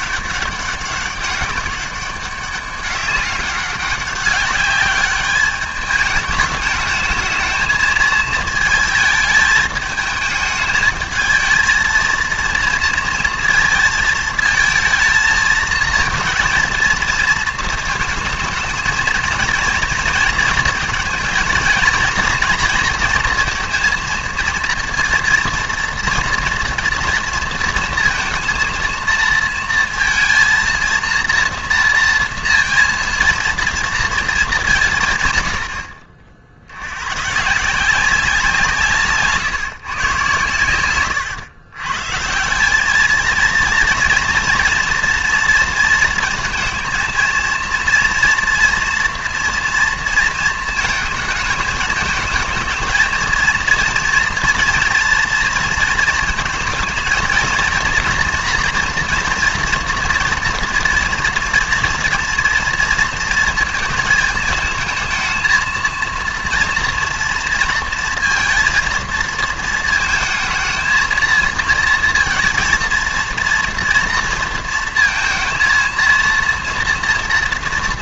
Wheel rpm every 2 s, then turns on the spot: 200, 200, 200, 210, 220, 220, 230, 220, 230, 220, 230, 230, 230, 230, 230, 230, 230, 200, 70, 170, 110, 170, 230, 220, 230, 230, 220, 240, 230, 230, 230, 230, 220, 230, 230, 230, 230, 230, 230.
none